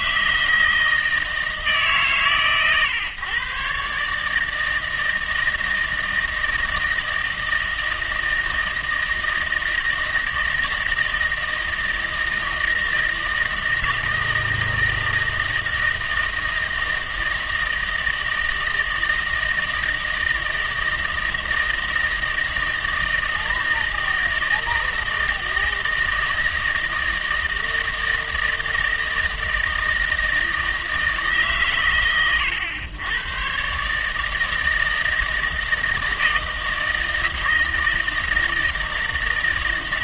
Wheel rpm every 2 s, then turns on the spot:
160, 130, 160, 160, 160, 160, 160, 160, 160, 160, 160, 160, 160, 160, 160, 160, 110, 160, 160, 160.
none